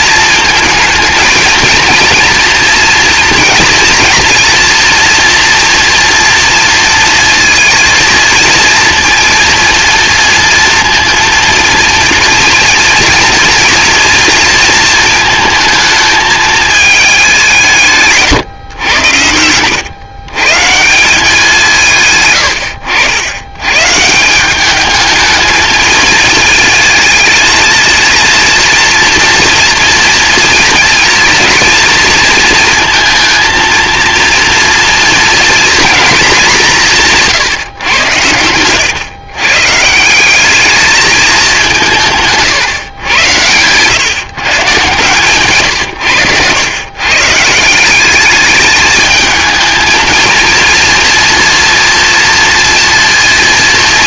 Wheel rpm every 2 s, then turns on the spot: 230, 230, 230, 230, 230, 230, 230, 230, 210, 100, 160, 90, 210, 230, 240, 240, 230, 230, 170, 120, 210, 130, 140, 120, 210, 230, 230.
22-24